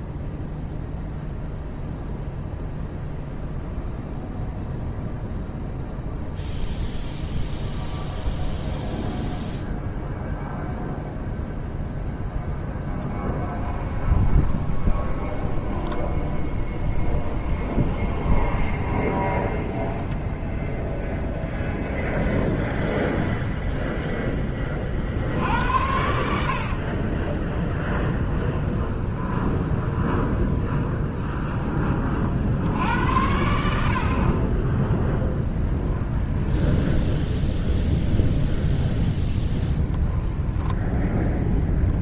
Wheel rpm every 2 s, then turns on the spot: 0, 0, 0, 0, 0, 0, 10, 20, 10, 20, 10, 10, 20, 60, 20, 0, 50, 20, 10, 10, 0.
14-20 26-30 36-38